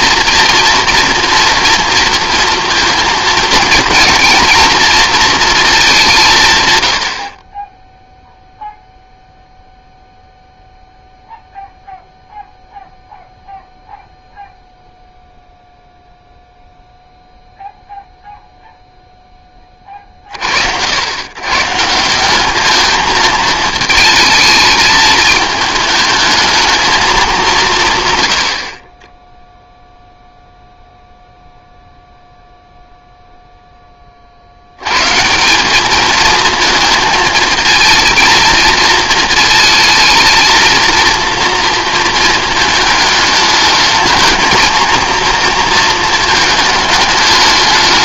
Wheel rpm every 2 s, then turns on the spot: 230, 230, 230, 110, 0, 0, 0, 0, 0, 0, 80, 210, 220, 220, 30, 0, 0, 100, 220, 230, 230, 220, 230, 220.
none